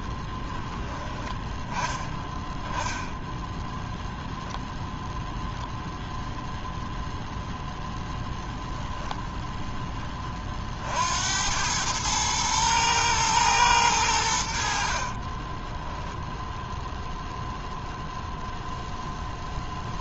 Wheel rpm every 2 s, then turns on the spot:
10, 10, 0, 0, 0, 50, 110, 70, 0, 0.
none